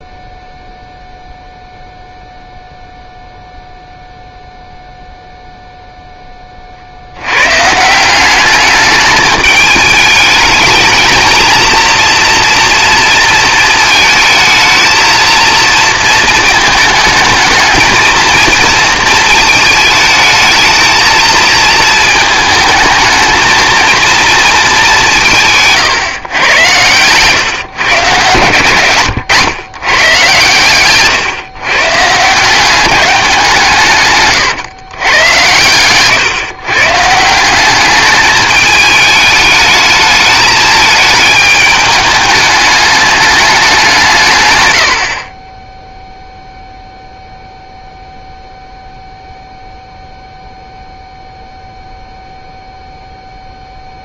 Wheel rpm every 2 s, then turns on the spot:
0, 0, 0, 30, 200, 220, 230, 220, 220, 230, 220, 220, 220, 100, 120, 130, 180, 130, 140, 210, 220, 210, 110, 0, 0, 0, 0.
none